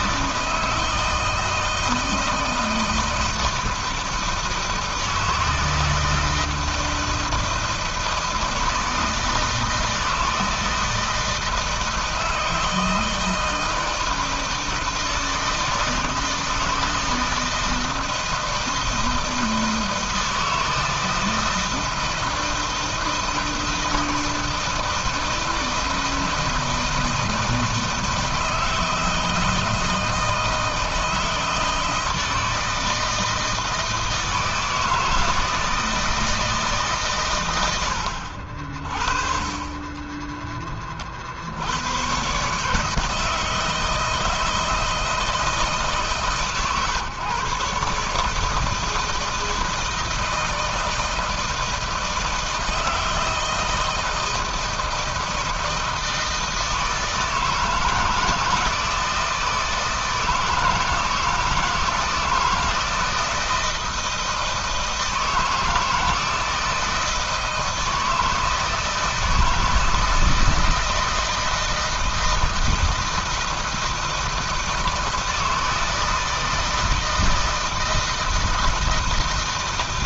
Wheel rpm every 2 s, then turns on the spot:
160, 160, 160, 160, 160, 160, 160, 160, 160, 160, 160, 160, 160, 160, 160, 160, 160, 160, 150, 50, 20, 150, 160, 140, 160, 160, 160, 160, 160, 160, 160, 160, 160, 160, 160, 160, 160, 160, 160, 160.
none